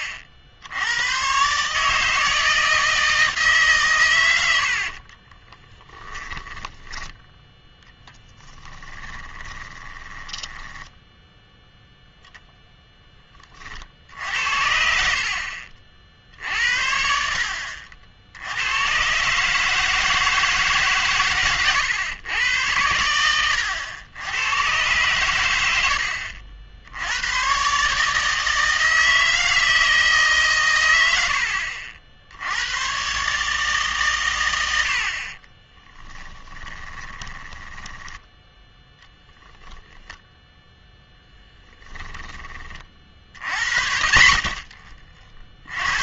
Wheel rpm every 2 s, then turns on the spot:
80, 160, 90, 20, 10, 10, 0, 70, 70, 90, 150, 100, 110, 80, 160, 120, 90, 90, 20, 10, 10, 40, 40.
6-12 36-38